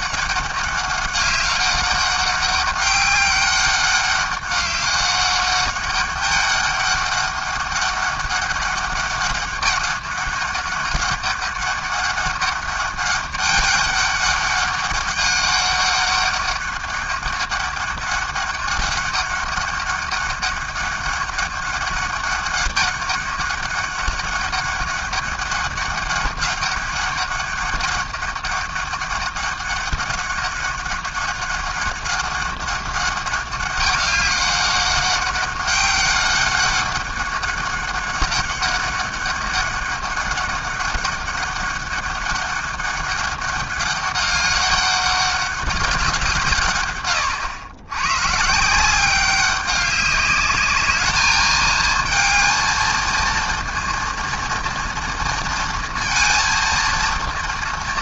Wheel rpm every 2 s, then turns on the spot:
200, 200, 200, 200, 200, 200, 200, 200, 200, 200, 200, 200, 200, 190, 200, 200, 200, 190, 200, 200, 200, 190, 200, 120, 170, 210, 230, 230, 230.
none